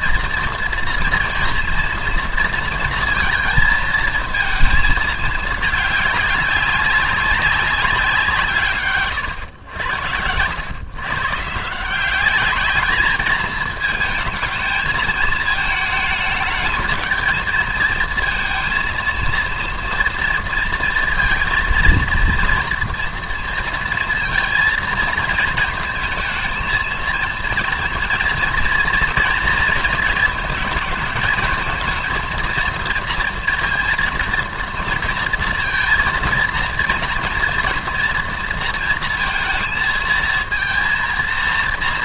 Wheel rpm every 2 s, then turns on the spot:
240, 230, 220, 200, 150, 100, 210, 220, 220, 230, 230, 230, 220, 230, 230, 220, 230, 230, 230, 230, 230.
none